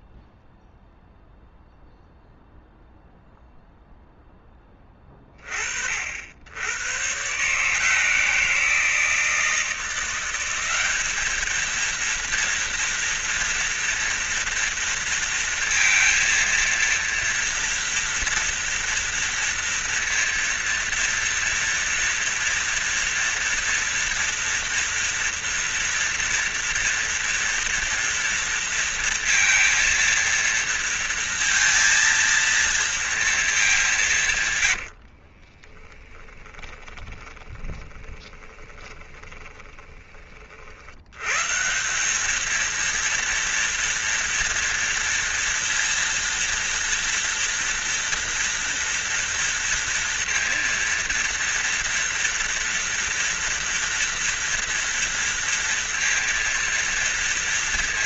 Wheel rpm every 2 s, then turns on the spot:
0, 0, 20, 110, 160, 200, 230, 230, 230, 230, 230, 240, 230, 230, 230, 230, 230, 110, 30, 20, 60, 230, 230, 230, 230, 230, 230, 230, 230.
34-40